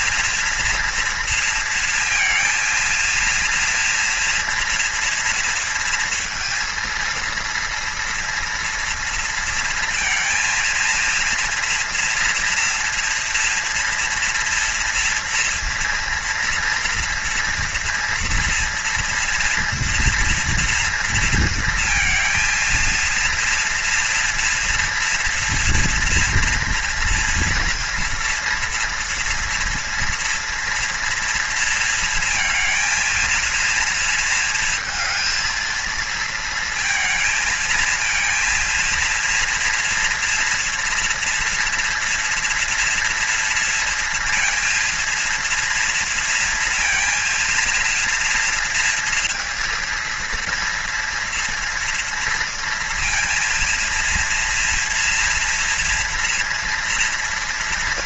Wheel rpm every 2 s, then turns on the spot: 230, 230, 230, 230, 230, 230, 230, 230, 240, 240, 240, 230, 240, 230, 230, 230, 230, 230, 220, 230, 230, 230, 230, 230, 230, 230, 230, 230, 230.
none